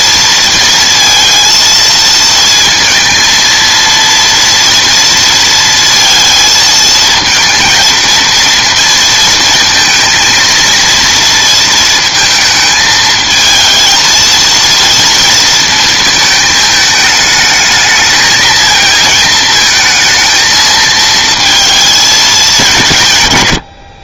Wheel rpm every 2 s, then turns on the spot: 230, 230, 230, 230, 230, 230, 220, 230, 210, 230, 230, 180.
none